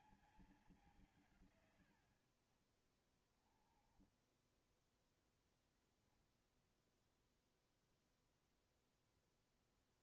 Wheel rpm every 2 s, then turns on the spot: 180, 80, 10, 0, 0.
4-6